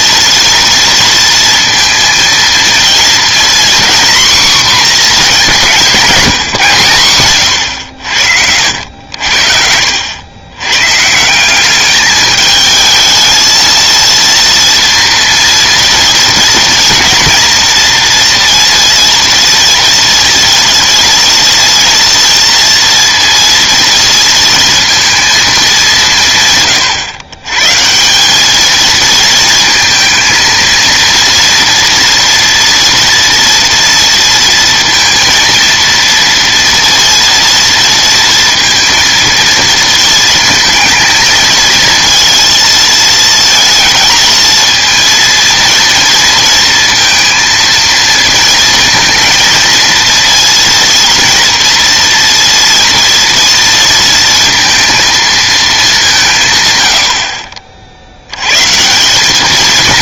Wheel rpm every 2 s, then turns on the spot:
230, 230, 240, 160, 70, 100, 220, 230, 230, 230, 230, 230, 230, 140, 210, 230, 230, 230, 230, 230, 220, 230, 220, 230, 220, 230, 230, 230, 130, 130.
none